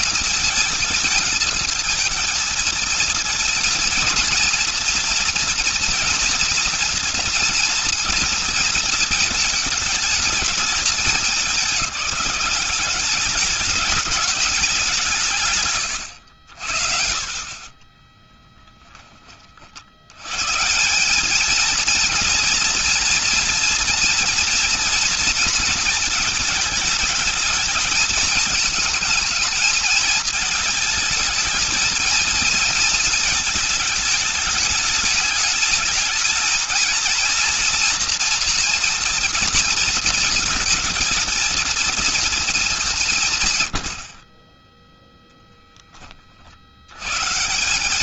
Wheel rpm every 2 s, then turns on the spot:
230, 230, 240, 240, 230, 220, 200, 200, 70, 10, 130, 230, 230, 220, 220, 220, 230, 220, 220, 240, 230, 220, 30, 50.
18-20